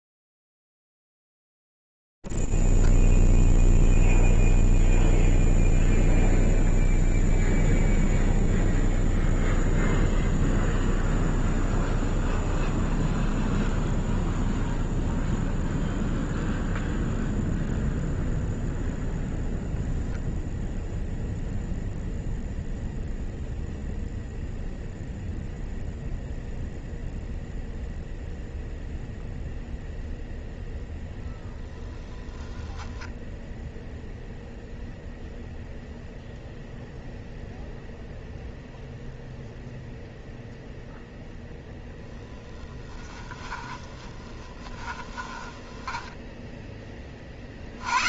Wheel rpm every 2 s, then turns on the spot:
0, 0, 0, 0, 0, 0, 0, 0, 0, 0, 0, 0, 0, 0, 0, 0, 10, 0, 0, 0, 0, 10, 10, 10.
32-34 42-46